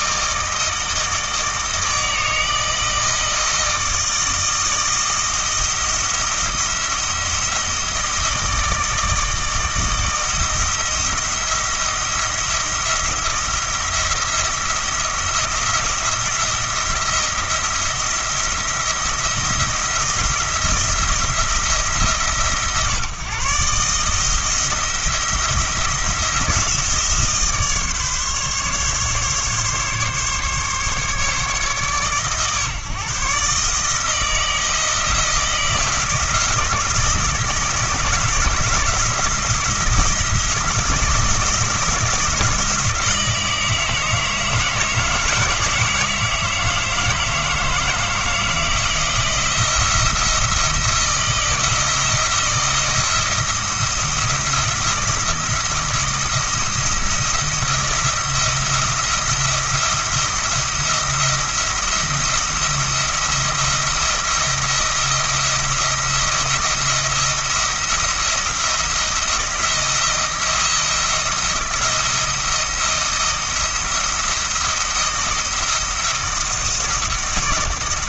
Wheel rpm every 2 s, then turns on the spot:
160, 160, 160, 170, 160, 160, 170, 170, 170, 170, 170, 130, 160, 160, 140, 140, 140, 160, 160, 160, 170, 160, 160, 160, 170, 170, 170, 170, 170, 170, 170, 160, 170, 170, 170, 170, 170, 160, 170.
none